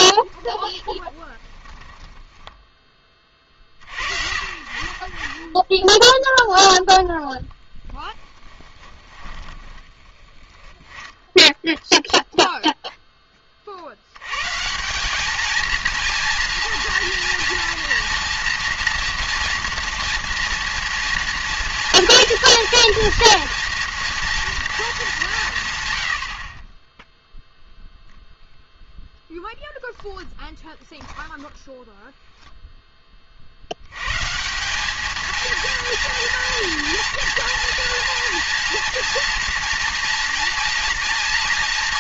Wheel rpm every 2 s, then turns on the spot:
20, 30, 30, 10, 30, 20, 0, 190, 240, 240, 230, 230, 210, 0, 0, 0, 0, 180, 230, 230, 230.
0-2 6-12